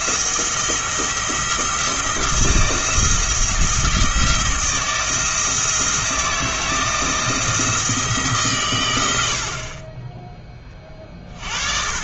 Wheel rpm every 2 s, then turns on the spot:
170, 170, 170, 160, 120, 20.
none